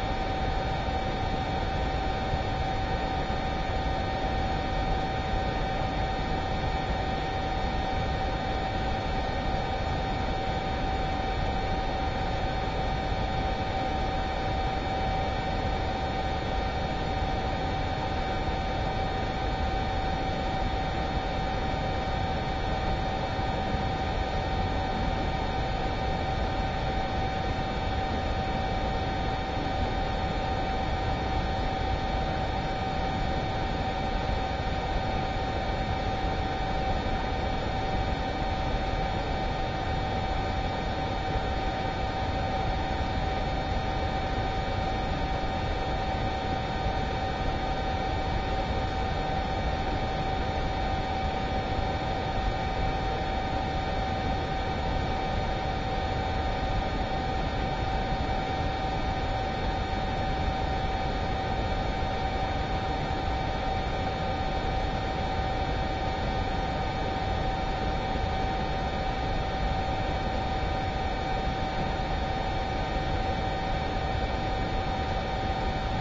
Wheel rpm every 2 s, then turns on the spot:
0, 0, 0, 0, 0, 0, 0, 0, 0, 0, 0, 0, 0, 0, 0, 0, 0, 0, 0, 0, 0, 0, 0, 0, 0, 0, 0, 0, 0, 0, 0, 0, 0, 0, 0, 0, 0, 0.
none